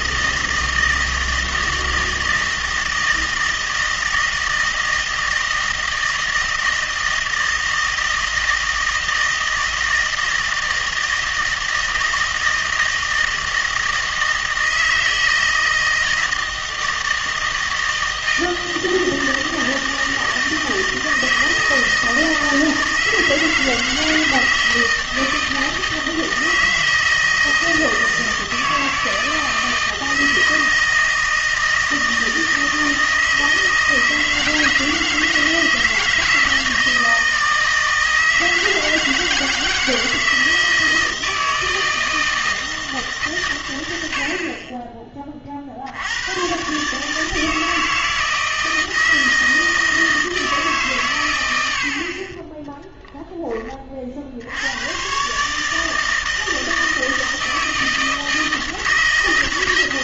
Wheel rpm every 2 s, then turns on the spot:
160, 160, 160, 160, 160, 160, 160, 160, 160, 160, 160, 160, 160, 160, 160, 160, 160, 160, 160, 160, 160, 160, 30, 130, 160, 150, 20, 90, 160, 160.
52-54